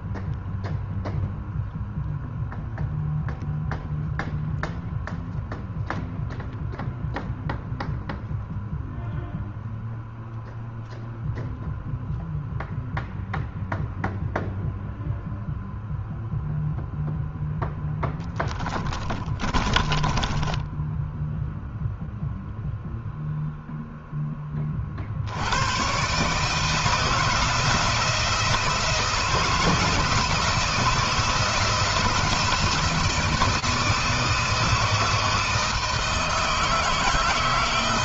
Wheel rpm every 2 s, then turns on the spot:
0, 0, 0, 0, 0, 0, 0, 0, 0, 10, 10, 0, 40, 160, 170, 160, 160, 160, 160.
18-20